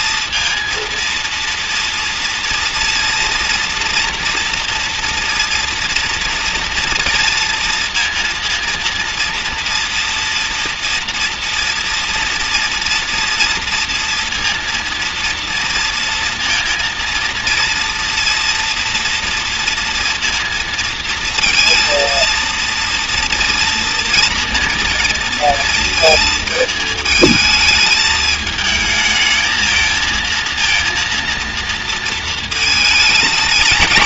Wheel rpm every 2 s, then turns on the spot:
230, 230, 240, 230, 230, 240, 240, 230, 230, 230, 230, 230, 230, 220, 220, 230, 230.
none